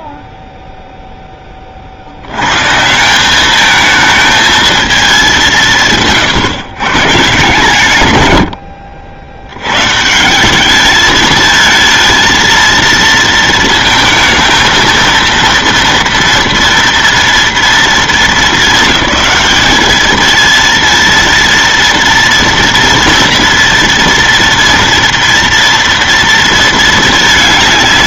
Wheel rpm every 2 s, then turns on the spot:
0, 120, 220, 140, 90, 200, 230, 220, 230, 210, 230, 230, 230, 230.
none